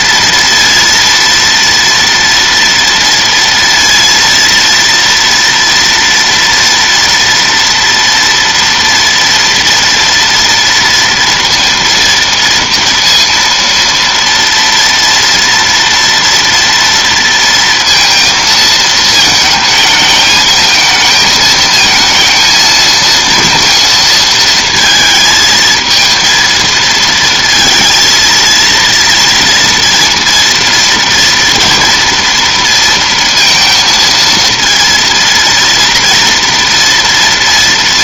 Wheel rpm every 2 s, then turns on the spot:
230, 230, 230, 230, 230, 230, 230, 230, 230, 230, 220, 230, 230, 230, 230, 230, 230, 230, 230.
none